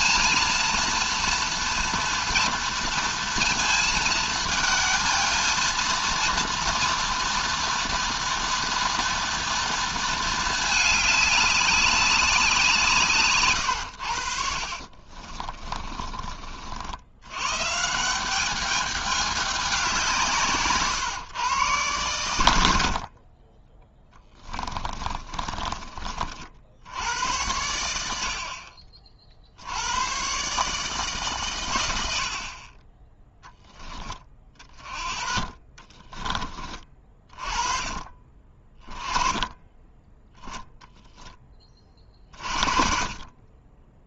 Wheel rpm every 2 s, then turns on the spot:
230, 230, 220, 230, 230, 210, 160, 50, 70, 200, 130, 60, 30, 70, 40, 150, 30, 30, 30, 20, 10, 40.
14-16 24-26 40-42